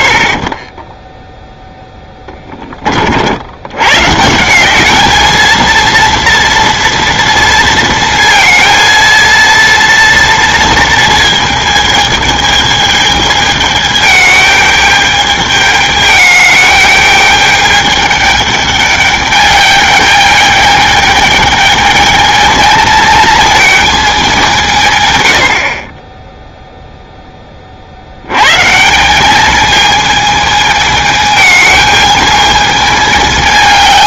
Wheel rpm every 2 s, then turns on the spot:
10, 30, 190, 230, 230, 230, 220, 210, 210, 210, 210, 220, 160, 0, 140, 220, 220.
none